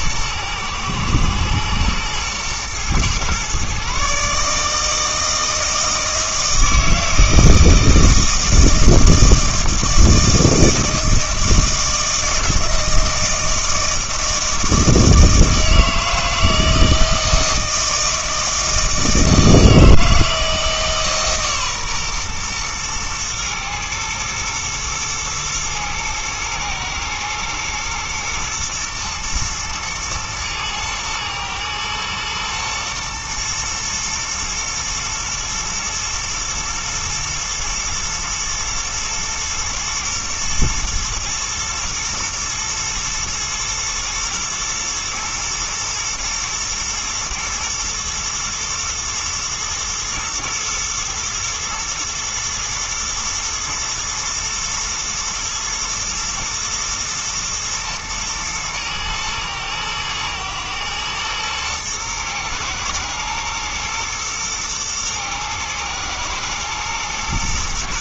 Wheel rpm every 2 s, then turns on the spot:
120, 120, 160, 160, 160, 160, 160, 160, 160, 160, 150, 120, 120, 110, 110, 110, 120, 110, 120, 110, 110, 110, 110, 120, 110, 110, 120, 120, 120, 110, 110, 110, 120, 110.
none